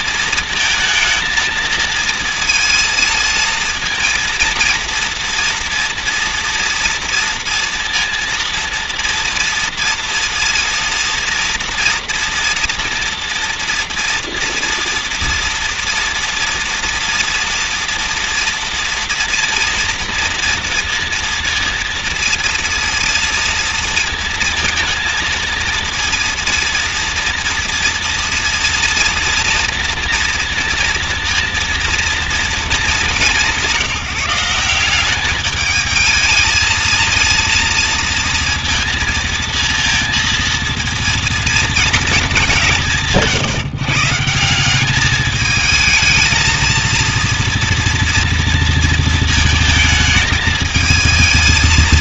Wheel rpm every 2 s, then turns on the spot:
230, 230, 230, 230, 230, 230, 230, 230, 230, 240, 230, 230, 230, 230, 230, 230, 220, 180, 220, 230, 230, 190, 190, 230, 230, 220.
none